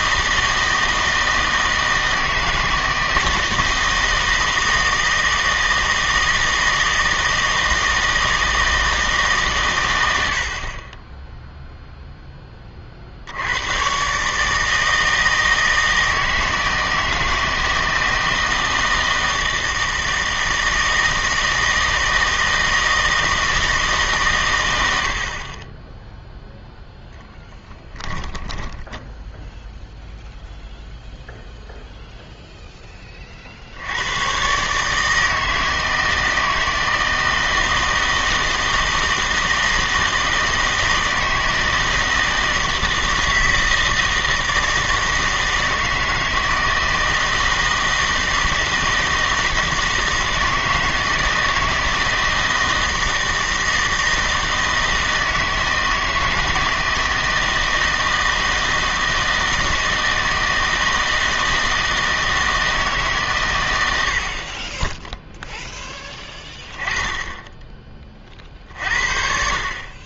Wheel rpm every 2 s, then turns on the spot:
160, 160, 160, 160, 160, 40, 30, 150, 160, 160, 160, 160, 110, 0, 10, 0, 0, 140, 160, 160, 160, 160, 160, 160, 160, 160, 160, 160, 160, 160, 160, 160, 30, 20, 50.
28-30